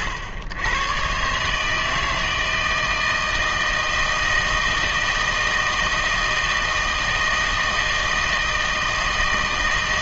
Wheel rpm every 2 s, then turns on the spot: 100, 160, 160, 160, 160.
none